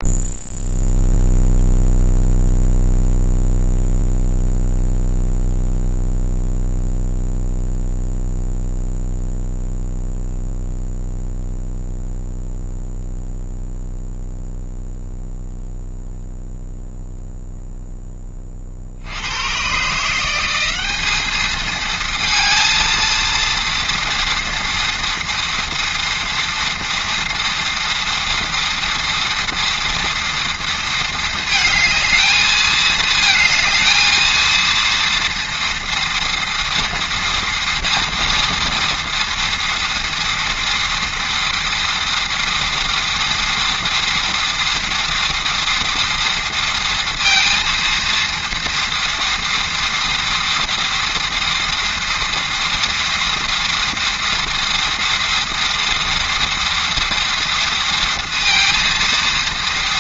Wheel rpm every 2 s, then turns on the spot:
0, 0, 0, 0, 0, 0, 0, 0, 0, 60, 200, 230, 230, 230, 230, 230, 220, 230, 230, 230, 230, 230, 230, 230, 230, 230, 240, 230, 230, 230.
none